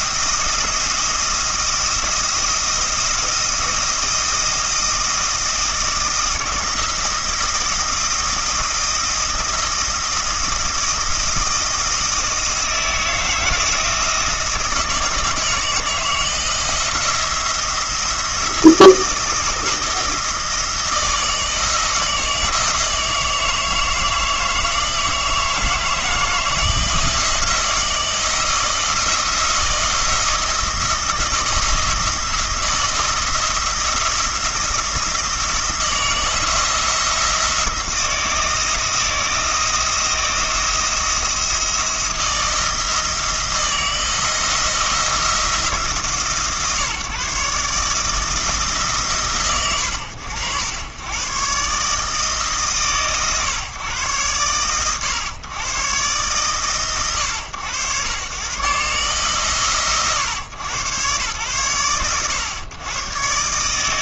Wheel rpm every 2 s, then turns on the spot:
170, 170, 160, 160, 170, 160, 160, 160, 170, 170, 160, 160, 160, 160, 160, 170, 170, 170, 170, 160, 170, 170, 170, 140, 160, 90, 140, 120, 120, 130, 110, 110.
none